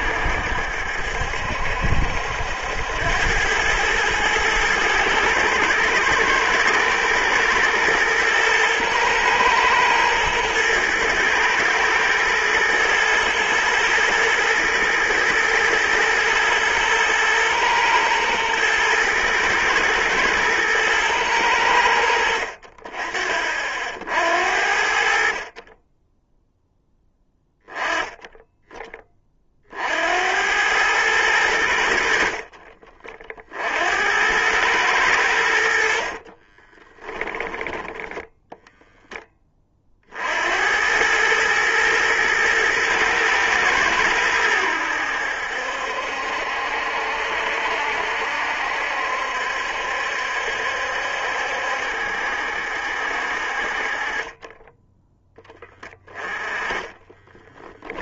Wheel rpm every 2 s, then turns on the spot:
70, 90, 110, 110, 120, 110, 110, 110, 120, 110, 110, 50, 60, 0, 20, 100, 40, 100, 20, 10, 90, 110, 80, 70, 70, 70, 60, 10, 10.
36-38 56-58